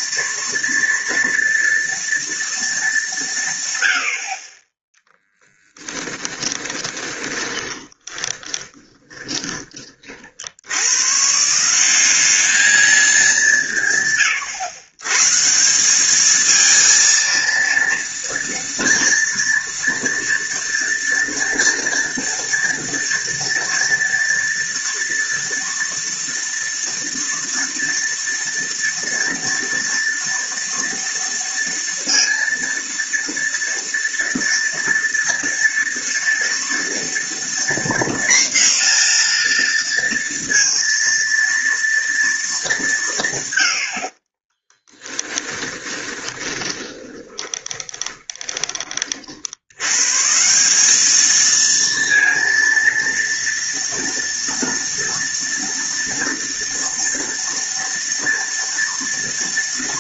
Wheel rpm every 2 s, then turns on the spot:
230, 220, 10, 20, 20, 100, 210, 140, 230, 230, 230, 230, 230, 230, 230, 230, 230, 230, 230, 240, 230, 180, 20, 20, 30, 200, 230, 230, 230, 230.
6-10 44-48